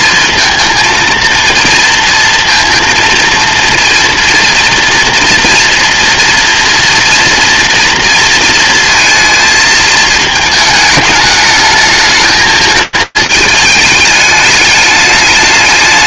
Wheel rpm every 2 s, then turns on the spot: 230, 230, 230, 230, 230, 220, 220, 210.
none